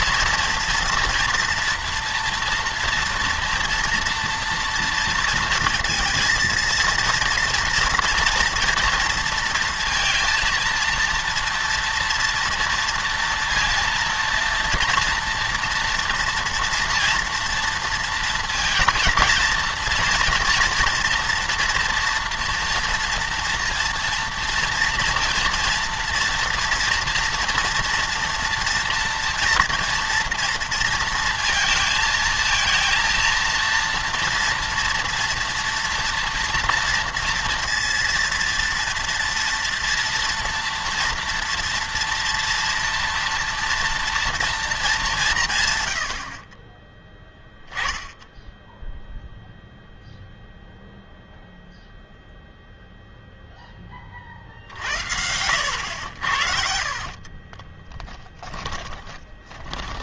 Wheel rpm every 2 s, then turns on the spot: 240, 230, 230, 230, 230, 230, 230, 240, 230, 230, 230, 230, 230, 230, 230, 230, 230, 230, 230, 230, 230, 230, 220, 30, 0, 0, 0, 60, 50, 30.
56-60